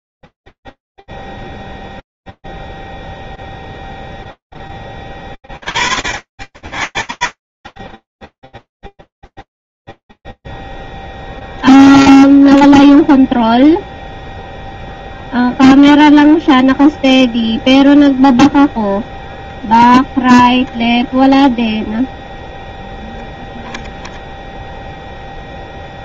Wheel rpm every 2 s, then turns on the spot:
0, 0, 20, 10, 0, 0, 0, 0, 0, 0, 0, 0, 0.
none